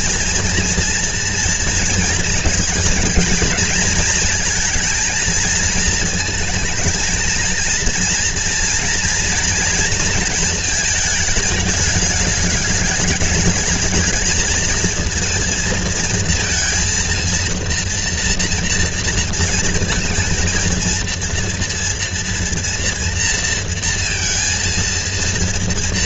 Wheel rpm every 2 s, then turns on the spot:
230, 230, 230, 230, 230, 220, 210, 230, 230, 230, 230, 230, 230.
none